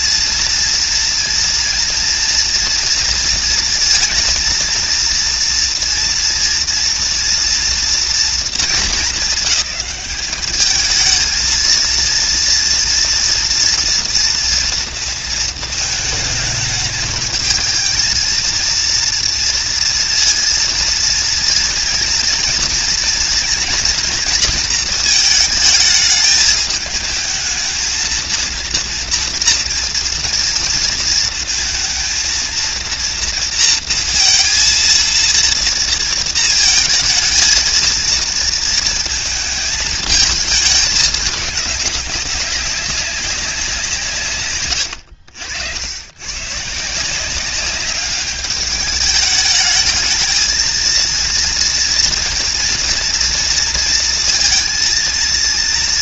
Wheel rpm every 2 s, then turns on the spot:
230, 230, 230, 230, 230, 200, 230, 230, 220, 220, 230, 230, 240, 220, 230, 240, 230, 230, 230, 230, 220, 200, 160, 100, 200, 220, 230, 230.
none